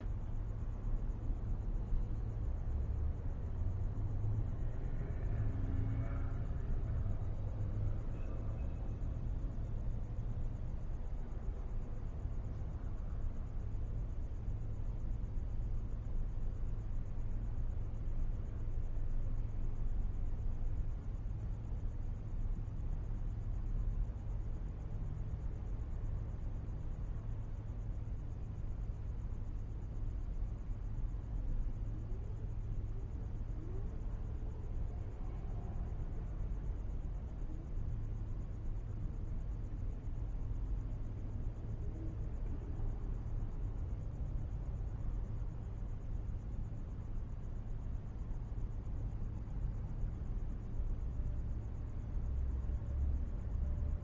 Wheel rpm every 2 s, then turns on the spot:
0, 0, 0, 0, 0, 0, 0, 0, 0, 0, 0, 0, 0, 0, 0, 0, 0, 0, 0, 0, 0, 0, 0, 0, 0, 0, 0.
none